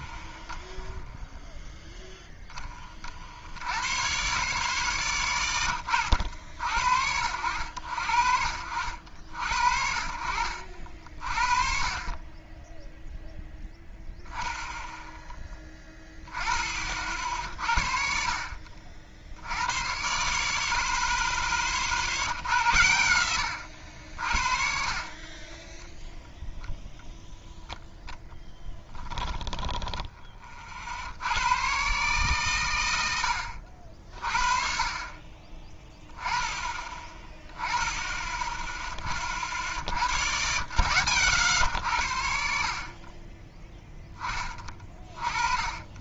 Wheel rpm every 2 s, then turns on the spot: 0, 10, 40, 60, 60, 60, 20, 10, 20, 50, 40, 100, 50, 0, 10, 40, 120, 40, 20, 10, 60, 50, 20.
28-30